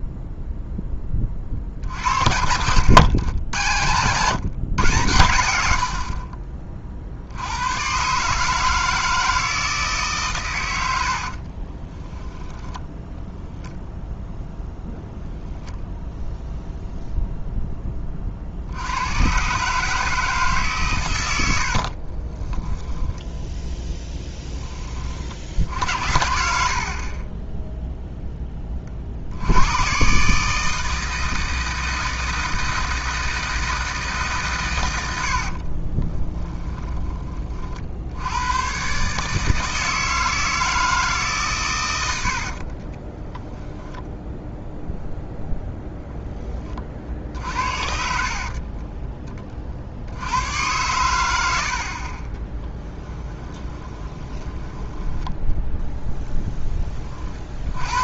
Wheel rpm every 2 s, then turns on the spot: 0, 80, 130, 40, 160, 80, 10, 0, 0, 80, 130, 10, 20, 50, 30, 160, 160, 120, 20, 130, 160, 40, 0, 30, 40, 100, 10, 10, 20.
12-14 22-24 36-38 42-44 48-50 52-56